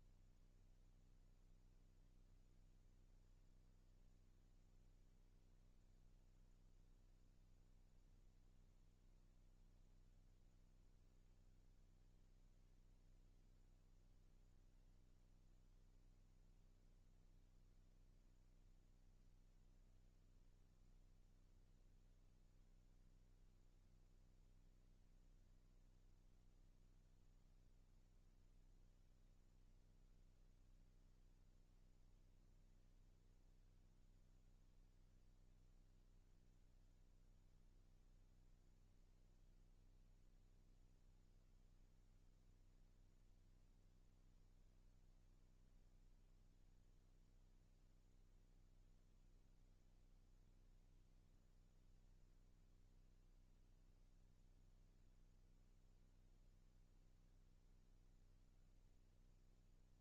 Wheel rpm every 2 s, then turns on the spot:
0, 0, 0, 0, 0, 0, 0, 0, 0, 0, 0, 0, 0, 0, 0, 0, 0, 0, 0, 0, 0, 0, 0, 0, 0, 0, 0, 0, 0, 0.
none